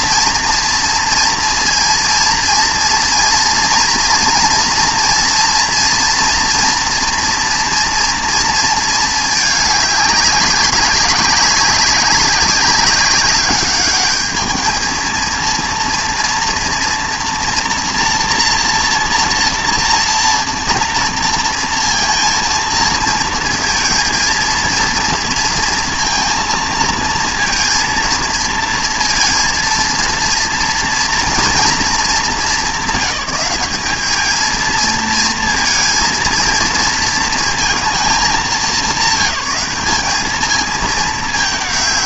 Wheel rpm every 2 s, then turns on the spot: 230, 230, 230, 230, 230, 200, 200, 220, 230, 230, 230, 230, 230, 230, 230, 230, 200, 230, 230, 200, 210.
none